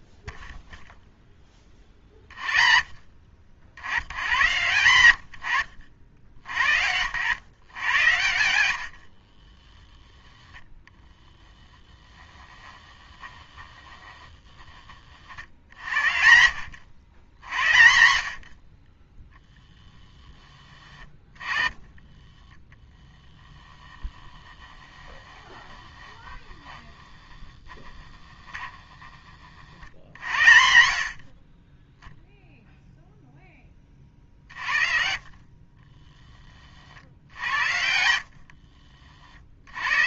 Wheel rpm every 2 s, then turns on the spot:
0, 40, 130, 60, 90, 20, 30, 20, 80, 40, 20, 20, 10, 10, 10, 70, 0, 50, 40, 50.
12-16 24-26 38-40